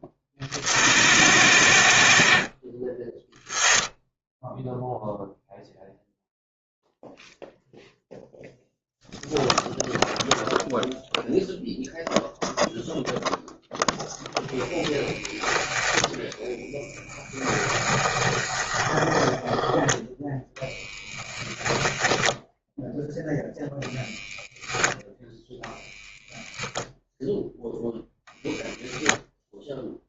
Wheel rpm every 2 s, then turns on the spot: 70, 20, 0, 0, 0, 0, 0, 10, 10, 20, 0, 10, 10, 0, 0.
14-20